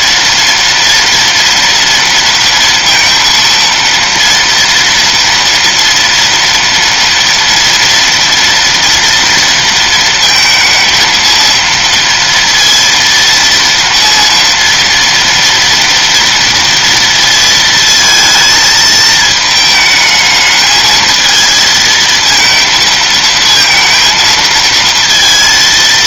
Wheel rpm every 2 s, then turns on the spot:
230, 230, 230, 230, 230, 230, 230, 230, 230, 220, 220, 230, 230.
none